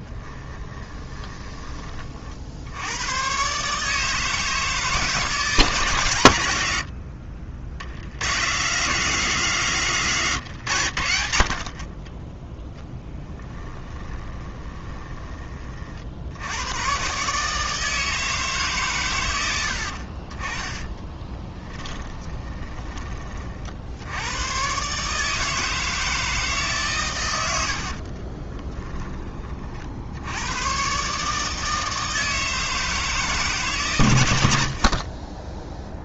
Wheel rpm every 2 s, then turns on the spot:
20, 100, 160, 80, 160, 90, 10, 20, 120, 130, 10, 20, 130, 140, 10, 130, 160, 50.
0-2 12-16 20-22